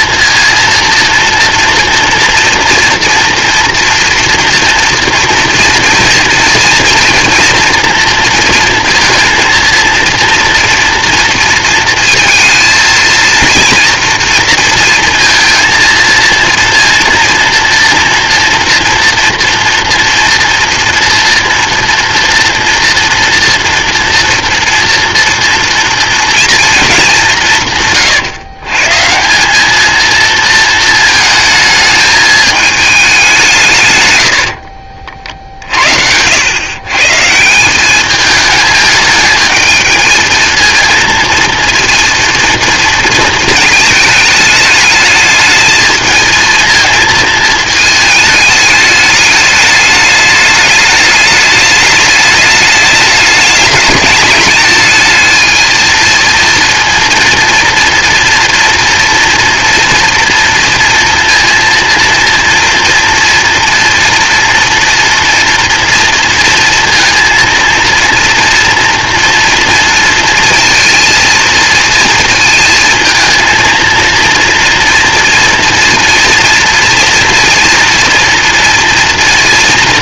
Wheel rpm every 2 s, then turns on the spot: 230, 240, 230, 230, 230, 230, 230, 230, 230, 230, 230, 240, 230, 220, 140, 220, 220, 60, 110, 210, 230, 230, 210, 220, 210, 210, 210, 210, 230, 230, 230, 230, 230, 230, 230, 230, 220, 230, 230, 230.
34-36